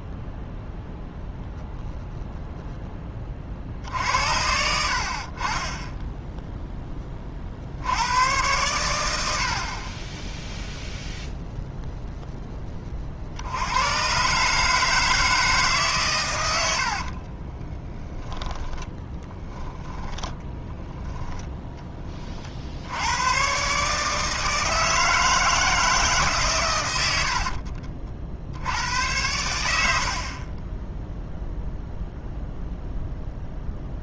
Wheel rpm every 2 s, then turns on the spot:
0, 0, 70, 10, 110, 0, 20, 150, 80, 10, 10, 80, 160, 120, 90, 10, 0.
16-18 20-22